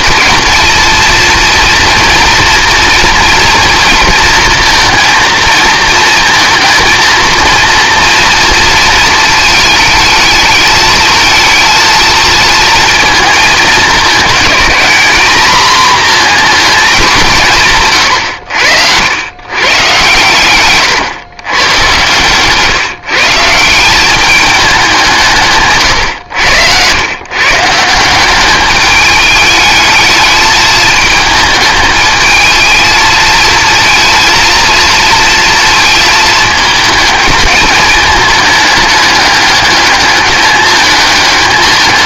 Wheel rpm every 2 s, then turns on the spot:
230, 230, 230, 230, 220, 220, 220, 230, 200, 90, 120, 160, 190, 110, 210, 220, 220, 230, 220, 210, 210.
none